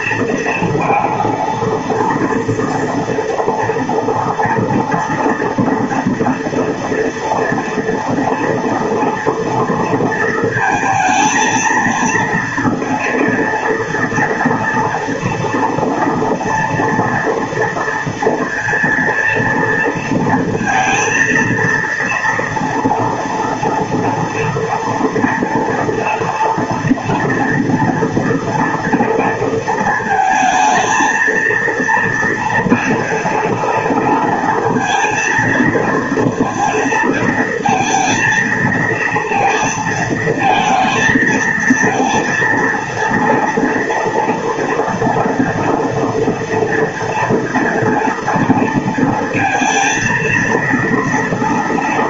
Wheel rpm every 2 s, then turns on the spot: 230, 230, 230, 230, 230, 220, 230, 240, 230, 230, 230, 230, 230, 230, 230, 230, 230, 230, 220, 230, 230, 230, 230, 230, 230, 230.
none